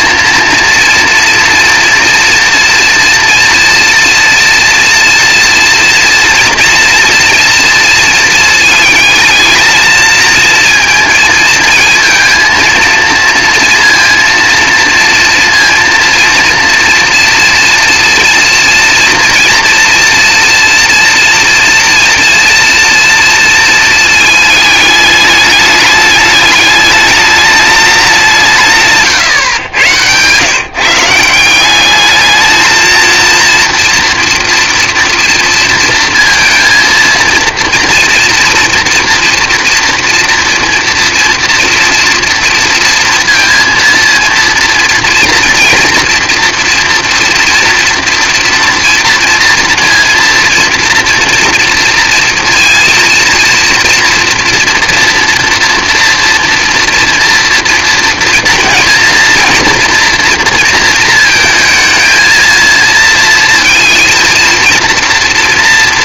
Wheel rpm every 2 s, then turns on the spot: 230, 240, 230, 230, 220, 230, 230, 230, 240, 230, 230, 230, 210, 210, 110, 200, 230, 230, 240, 230, 230, 230, 230, 230, 240, 230, 230, 230, 230, 230, 220, 230, 230.
28-30